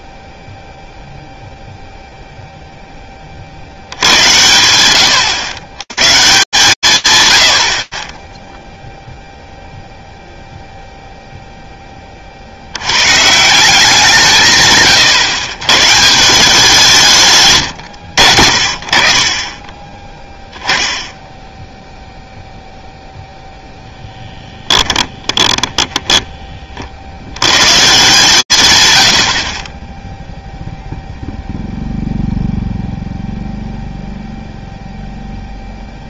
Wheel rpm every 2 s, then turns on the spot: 0, 20, 100, 140, 0, 0, 120, 120, 160, 20, 10, 0, 30, 70, 90, 0, 0, 0.
24-26